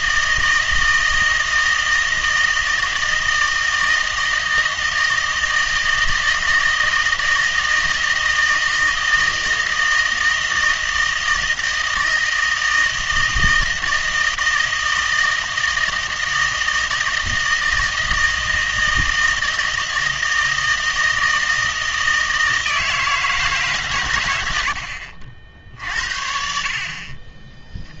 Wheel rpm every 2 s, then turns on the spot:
160, 160, 160, 160, 160, 160, 160, 160, 160, 160, 160, 160, 80, 60.
none